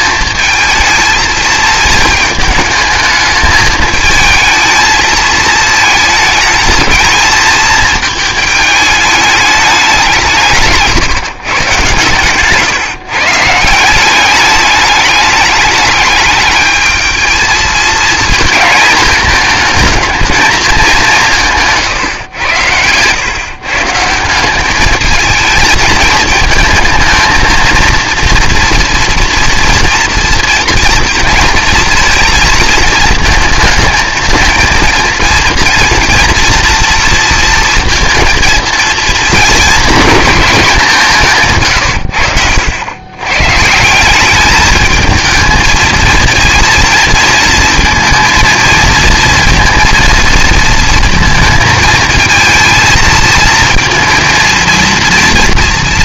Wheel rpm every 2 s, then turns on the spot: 220, 220, 220, 220, 220, 150, 140, 200, 220, 230, 210, 110, 200, 220, 230, 230, 230, 230, 230, 230, 190, 90, 210, 230, 230, 230, 230, 230.
22-24